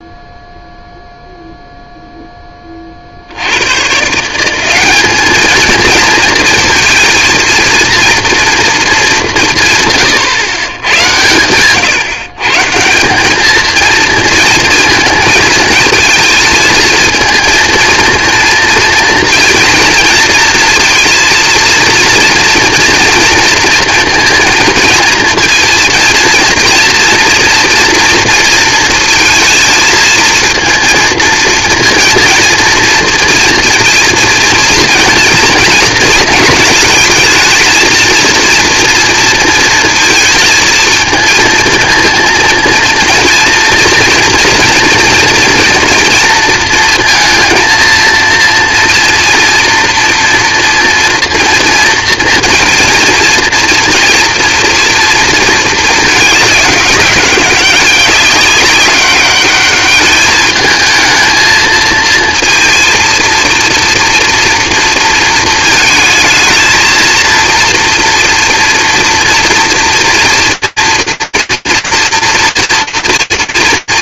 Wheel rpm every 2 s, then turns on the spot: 0, 30, 200, 230, 220, 110, 160, 220, 230, 230, 230, 230, 230, 230, 220, 230, 230, 230, 220, 230, 230, 230, 230, 230, 230, 230, 230, 230, 200, 200, 220, 230, 230, 230, 230, 230, 230.
none